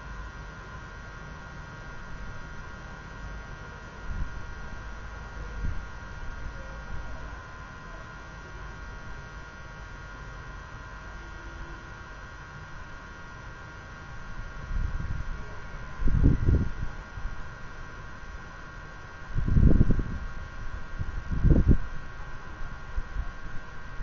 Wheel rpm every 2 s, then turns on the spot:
0, 0, 0, 0, 0, 0, 0, 0, 0, 0, 0, 0.
none